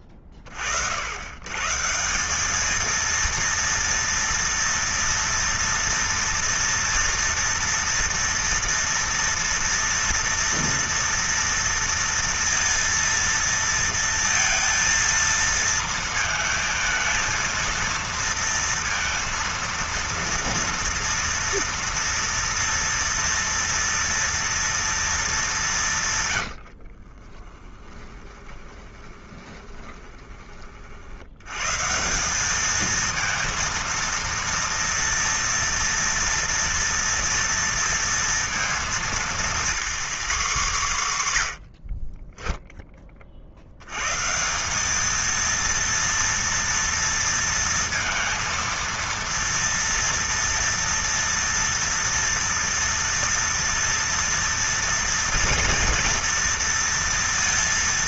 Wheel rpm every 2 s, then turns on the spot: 40, 210, 230, 230, 230, 230, 230, 230, 220, 230, 230, 230, 230, 80, 20, 40, 210, 230, 230, 230, 230, 10, 170, 230, 230, 230, 230, 230, 230.
26-30